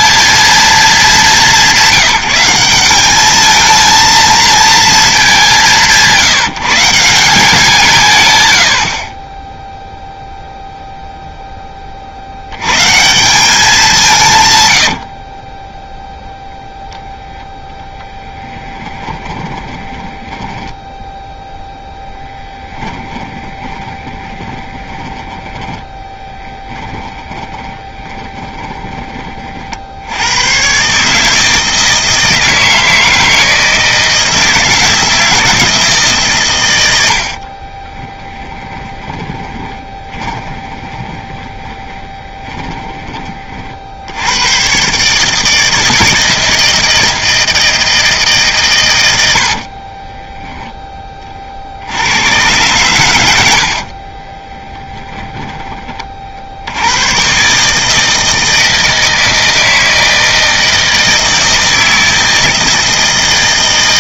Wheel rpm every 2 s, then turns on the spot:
220, 190, 220, 160, 90, 0, 140, 90, 0, 20, 10, 10, 10, 20, 20, 130, 160, 160, 110, 20, 20, 20, 130, 160, 140, 0, 120, 10, 90, 160, 160, 160.
14-16 18-30 38-44 54-56